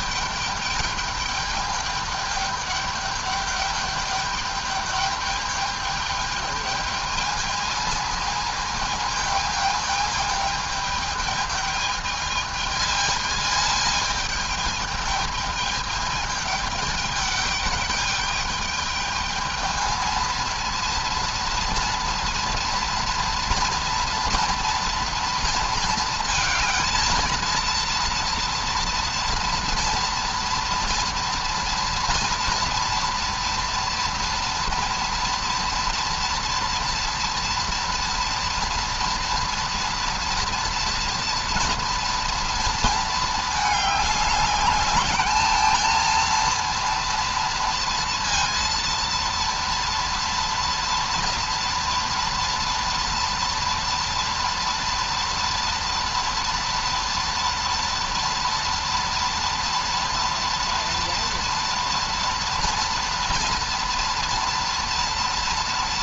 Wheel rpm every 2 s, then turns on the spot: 210, 210, 210, 210, 220, 220, 220, 220, 210, 210, 230, 230, 230, 230, 230, 230, 230, 230, 230, 230, 230, 230, 200, 230, 230, 230, 240, 230, 230, 230, 230, 230, 230.
none